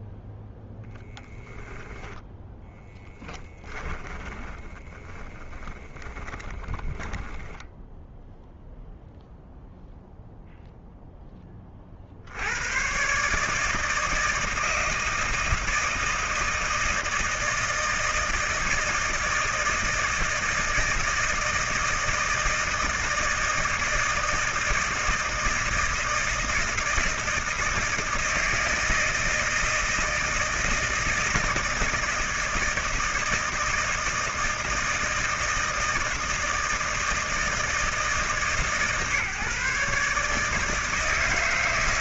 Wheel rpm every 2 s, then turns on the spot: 0, 10, 20, 20, 0, 0, 80, 160, 160, 160, 160, 160, 160, 160, 160, 160, 160, 160, 160, 140, 150.
2-8